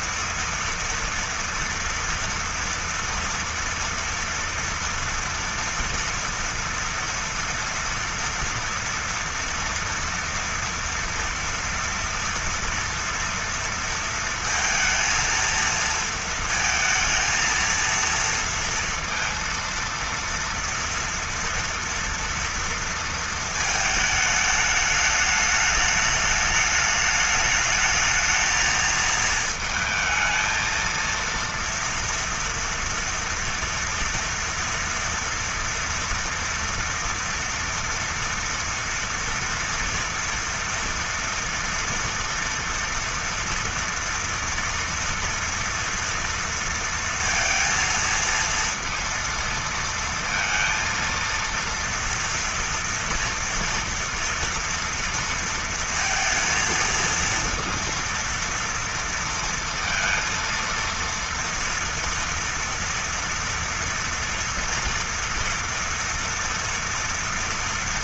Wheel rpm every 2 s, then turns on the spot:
240, 230, 230, 230, 230, 230, 230, 230, 230, 230, 230, 230, 210, 210, 220, 220, 230, 230, 230, 240, 230, 230, 230, 230, 230, 230, 230, 230, 230, 230, 230, 230, 230, 230.
none